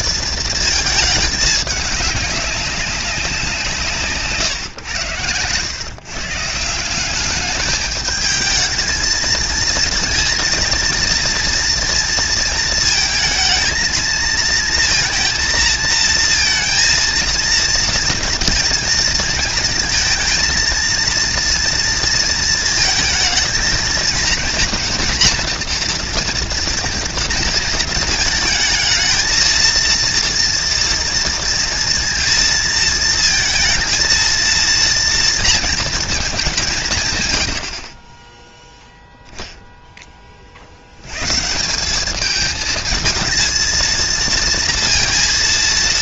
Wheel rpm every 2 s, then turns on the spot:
220, 200, 110, 180, 220, 230, 220, 230, 230, 230, 230, 230, 240, 230, 220, 230, 230, 230, 170, 0, 70, 220, 230.
none